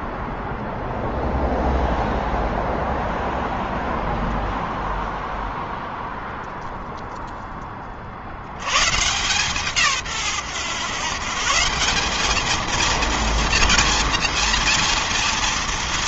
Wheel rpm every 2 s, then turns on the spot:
0, 0, 0, 0, 80, 130, 210, 230.
none